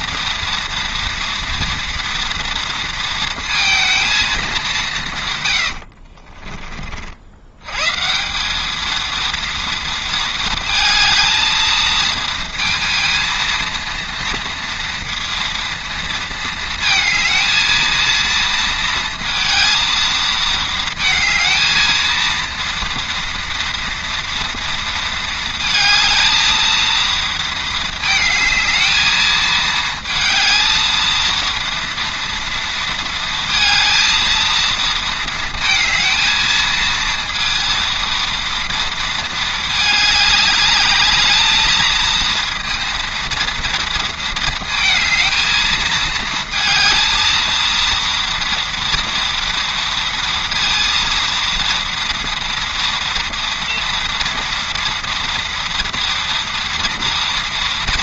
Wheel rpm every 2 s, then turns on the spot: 230, 230, 180, 40, 220, 220, 230, 230, 220, 230, 220, 230, 230, 230, 220, 230, 230, 230, 220, 230, 210, 230, 230, 220, 230, 230, 230, 230, 230.
none